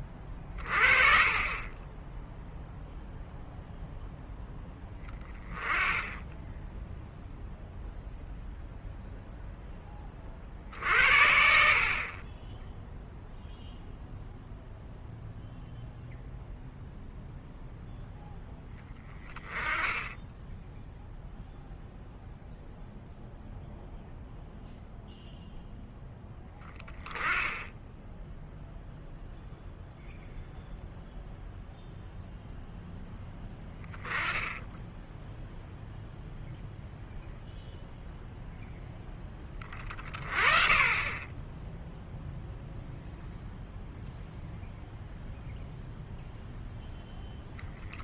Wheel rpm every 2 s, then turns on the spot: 30, 0, 10, 10, 0, 60, 10, 0, 0, 10, 0, 0, 0, 10, 0, 0, 0, 10, 0, 0, 20, 0, 0, 0.
none